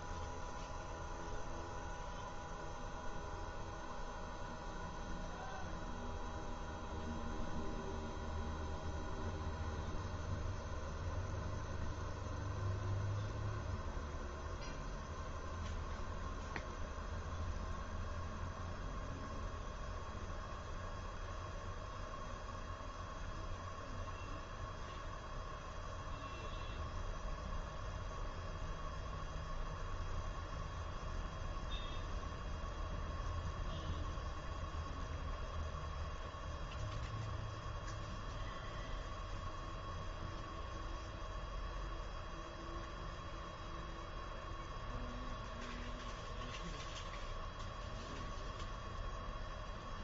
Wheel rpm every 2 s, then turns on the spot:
0, 0, 0, 0, 0, 0, 0, 0, 0, 0, 0, 0, 0, 0, 0, 0, 0, 0, 0, 0, 0, 0, 0, 0, 0.
none